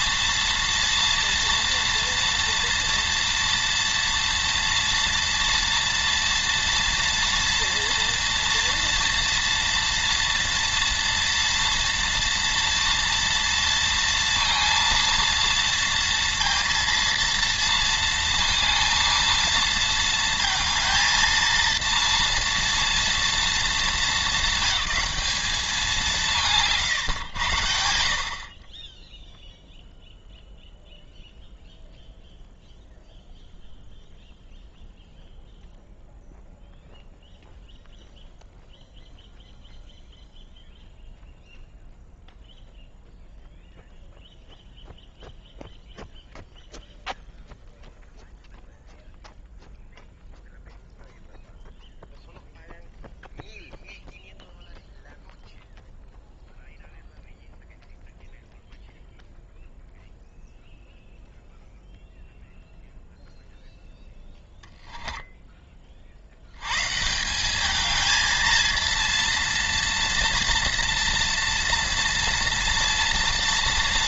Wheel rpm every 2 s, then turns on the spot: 240, 230, 230, 230, 230, 230, 230, 230, 230, 230, 220, 230, 220, 160, 50, 0, 0, 0, 0, 0, 0, 0, 0, 0, 0, 0, 0, 0, 0, 0, 0, 0, 0, 120, 230, 240, 230.
none